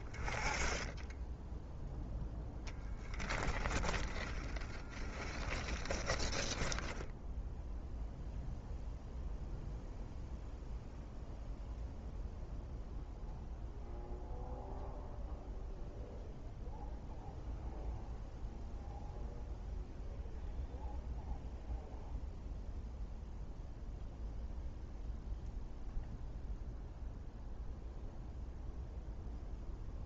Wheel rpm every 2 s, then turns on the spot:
10, 10, 10, 10, 0, 0, 0, 0, 0, 0, 0, 0, 0, 0, 0.
4-8